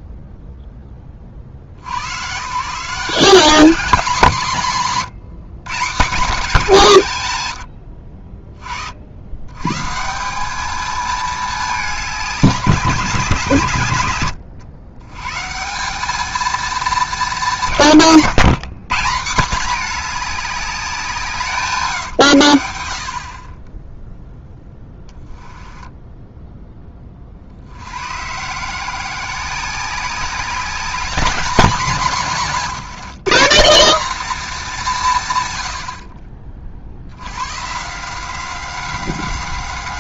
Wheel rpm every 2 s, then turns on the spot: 30, 170, 130, 180, 60, 220, 170, 110, 230, 190, 190, 80, 10, 10, 160, 210, 200, 200, 70, 190.
none